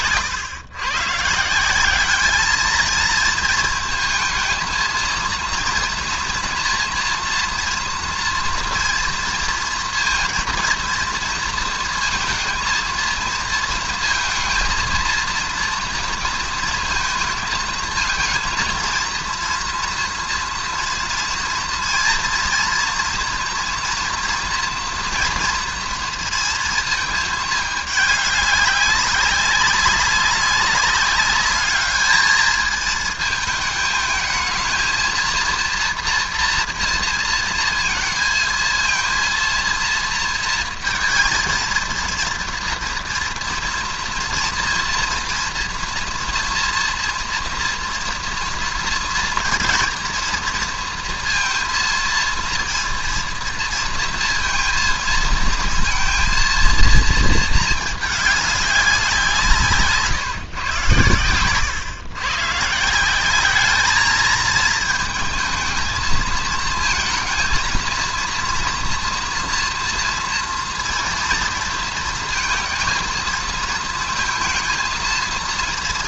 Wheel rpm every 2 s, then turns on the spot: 110, 220, 230, 230, 230, 230, 230, 230, 230, 230, 240, 240, 230, 230, 200, 200, 220, 220, 230, 220, 230, 230, 230, 240, 230, 230, 230, 230, 230, 210, 120, 140, 220, 220, 230, 240, 230, 230.
none